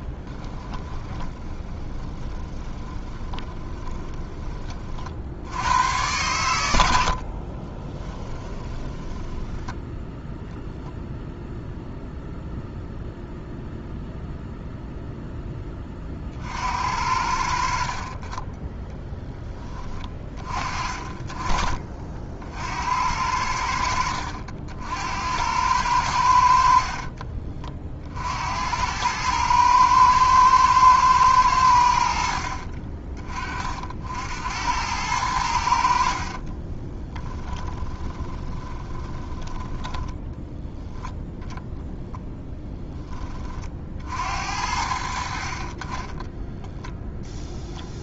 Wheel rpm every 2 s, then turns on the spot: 20, 20, 30, 110, 20, 0, 0, 0, 60, 10, 30, 60, 70, 60, 80, 110, 50, 80, 30, 20, 10, 10, 70, 0.
0-4 8-10 36-40